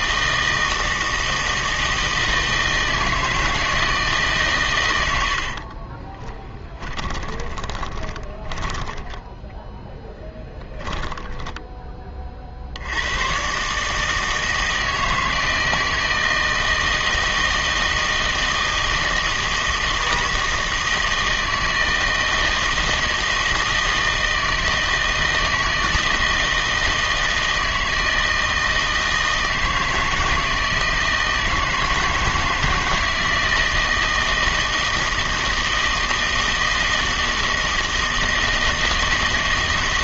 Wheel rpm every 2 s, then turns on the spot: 160, 160, 120, 20, 10, 10, 70, 160, 160, 160, 160, 160, 160, 160, 160, 160, 160, 160, 160, 160.
6-12